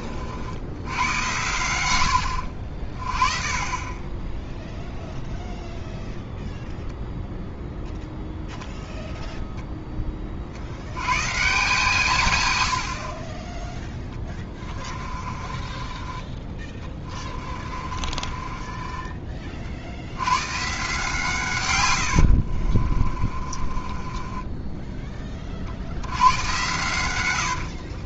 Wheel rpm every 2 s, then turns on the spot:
80, 60, 0, 0, 0, 60, 100, 20, 20, 30, 120, 60, 20, 100.
12-20 22-26